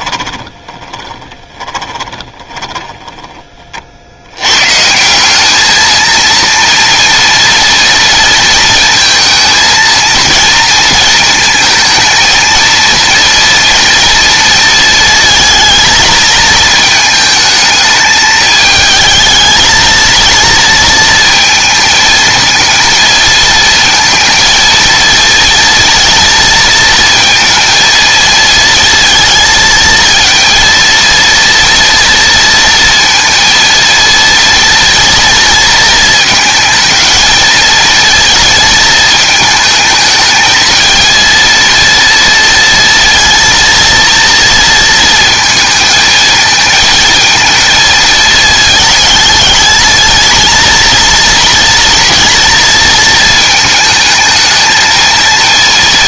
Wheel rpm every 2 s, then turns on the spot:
30, 10, 130, 230, 230, 220, 230, 230, 220, 220, 230, 230, 230, 230, 230, 230, 230, 230, 230, 220, 220, 230, 230, 220, 220, 230, 230, 220.
0-4